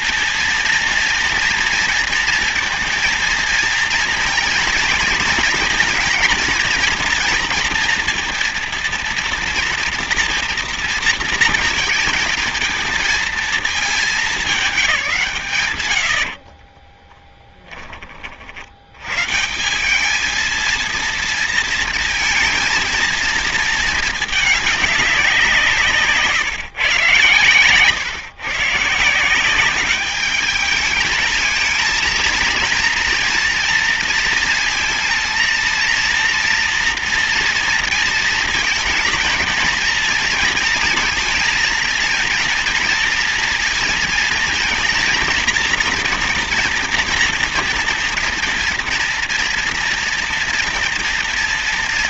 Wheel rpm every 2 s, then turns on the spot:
230, 230, 230, 230, 230, 230, 220, 210, 50, 60, 220, 230, 210, 140, 140, 210, 220, 230, 230, 220, 230, 230, 230, 240, 230, 230.
16-18